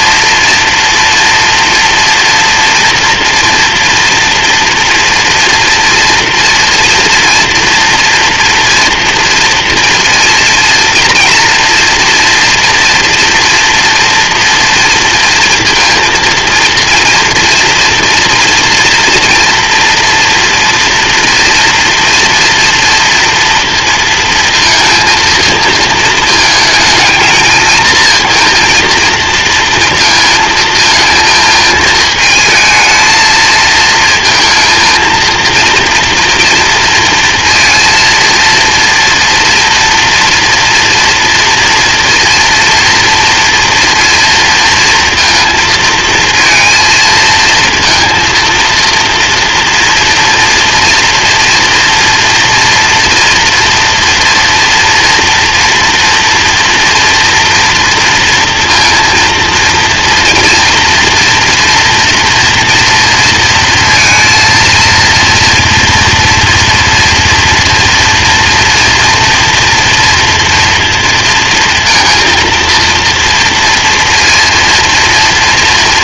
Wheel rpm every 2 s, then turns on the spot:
240, 230, 230, 230, 230, 230, 230, 230, 230, 230, 230, 230, 230, 220, 230, 230, 220, 230, 230, 230, 240, 230, 230, 220, 230, 230, 230, 230, 230, 230, 230, 230, 230, 240, 240, 230, 230, 230.
none